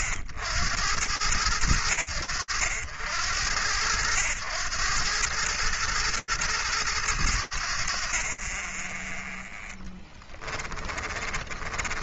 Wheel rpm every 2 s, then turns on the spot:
60, 90, 100, 110, 30, 40.
10-12